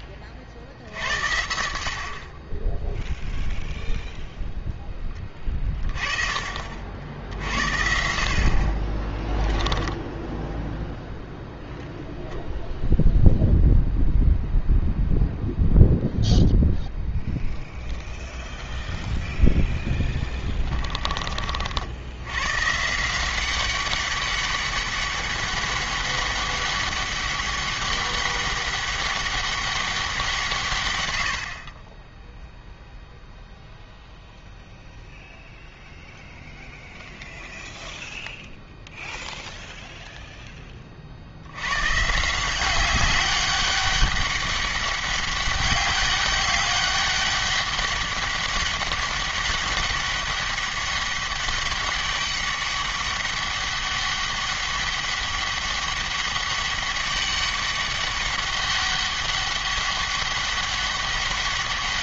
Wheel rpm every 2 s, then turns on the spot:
60, 10, 10, 50, 30, 0, 0, 0, 0, 0, 20, 150, 200, 200, 200, 130, 0, 0, 0, 0, 30, 190, 200, 200, 200, 200, 200, 200, 200, 200, 200.
20-22